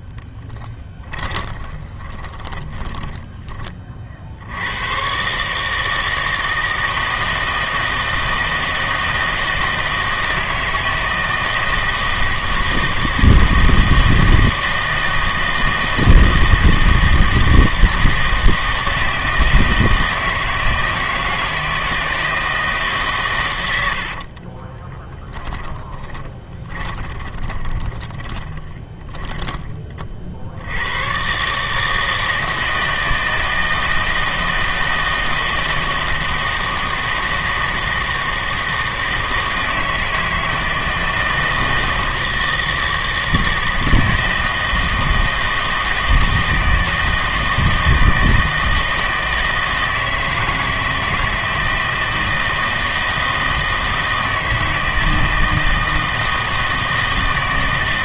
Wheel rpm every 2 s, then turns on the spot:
20, 20, 90, 160, 160, 160, 160, 160, 160, 160, 160, 160, 30, 20, 20, 70, 160, 160, 160, 160, 160, 160, 160, 160, 160, 160, 160, 160, 160.
0-4 24-30